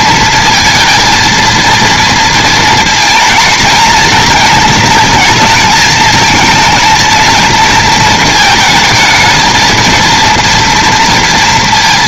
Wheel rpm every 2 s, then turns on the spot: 230, 230, 230, 230, 220, 230.
none